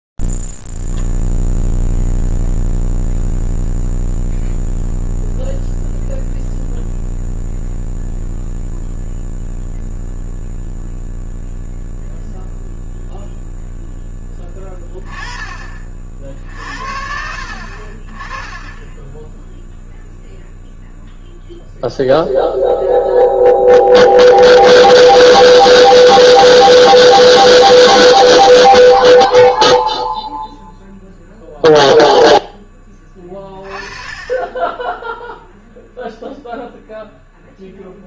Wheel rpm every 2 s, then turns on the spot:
0, 0, 0, 0, 0, 0, 0, 10, 50, 10, 0, 0, 0, 0, 30, 0, 10, 10, 0.
18-20